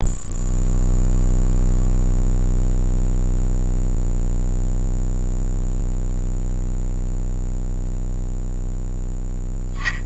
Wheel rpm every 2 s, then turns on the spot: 0, 0, 0, 0, 0.
none